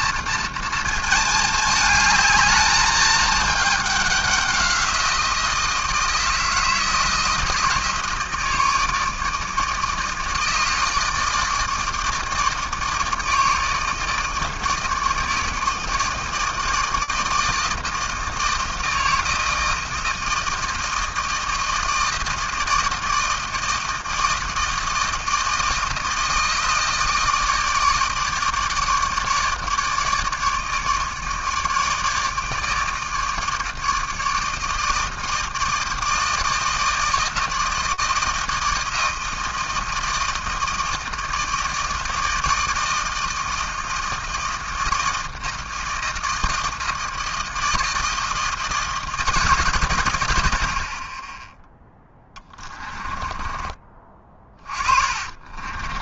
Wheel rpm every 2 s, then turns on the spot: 230, 220, 190, 160, 160, 160, 150, 160, 160, 160, 160, 160, 160, 160, 150, 150, 150, 160, 160, 160, 160, 160, 160, 160, 160, 80, 30, 30.
52-56